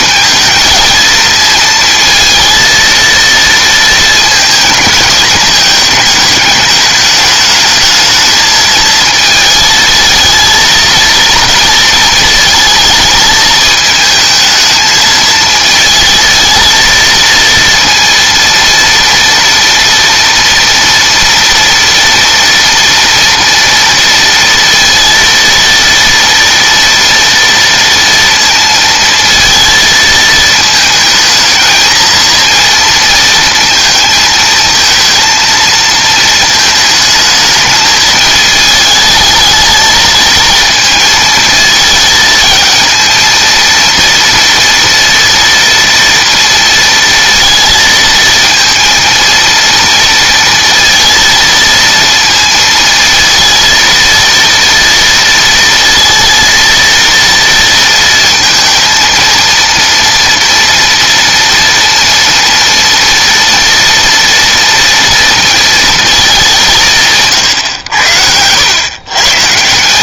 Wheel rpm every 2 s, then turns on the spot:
220, 230, 220, 210, 220, 230, 230, 220, 220, 230, 230, 230, 230, 230, 230, 220, 230, 220, 230, 220, 220, 220, 230, 230, 230, 230, 230, 230, 230, 230, 230, 230, 230, 210, 90.
none